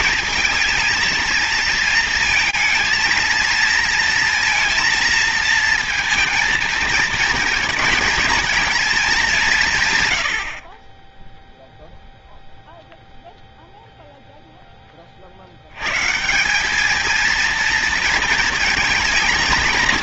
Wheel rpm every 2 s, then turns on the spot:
230, 230, 230, 230, 220, 50, 0, 10, 180, 220.
none